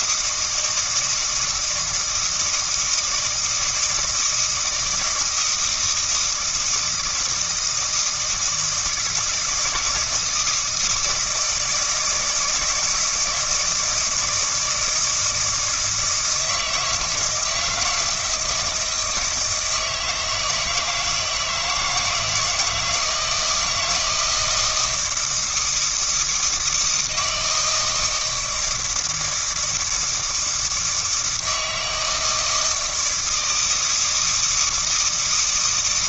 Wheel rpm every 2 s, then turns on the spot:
160, 160, 160, 160, 160, 160, 170, 160, 160, 160, 160, 160, 160, 160, 160, 160, 160, 160.
none